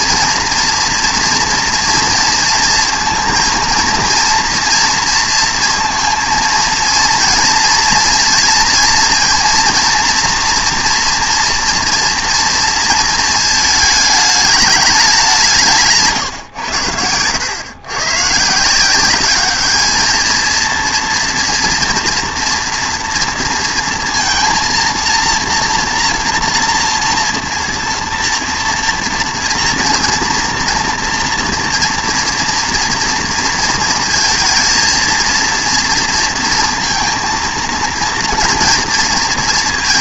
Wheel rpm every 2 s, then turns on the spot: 230, 230, 230, 230, 230, 230, 230, 210, 110, 160, 230, 240, 230, 230, 230, 240, 230, 230, 230, 230.
none